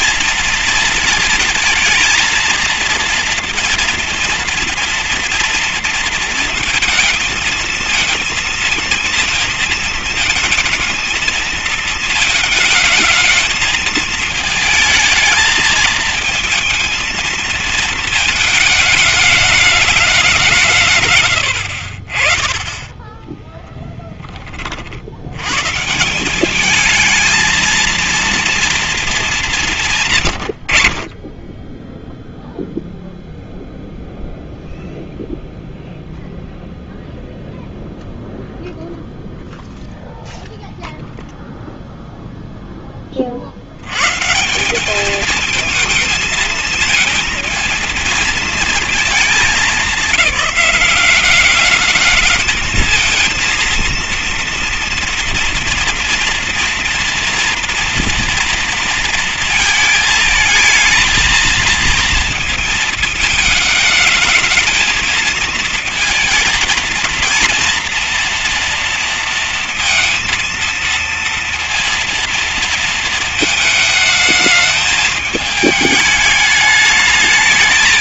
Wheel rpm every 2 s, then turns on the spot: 230, 230, 230, 230, 230, 220, 220, 220, 230, 220, 150, 10, 30, 210, 230, 110, 0, 0, 0, 0, 0, 10, 190, 220, 220, 200, 220, 230, 230, 230, 220, 230, 220, 230, 230, 230, 230, 220, 210.
none